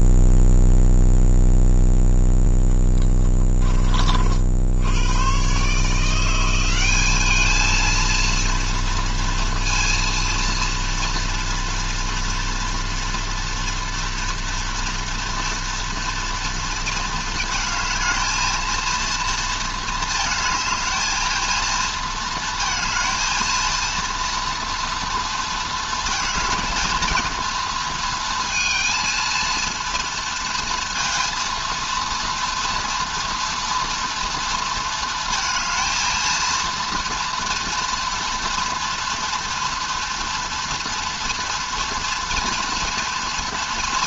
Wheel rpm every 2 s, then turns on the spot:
0, 10, 100, 200, 240, 230, 230, 230, 220, 230, 220, 230, 230, 230, 230, 230, 240, 220, 230, 230, 230, 240.
none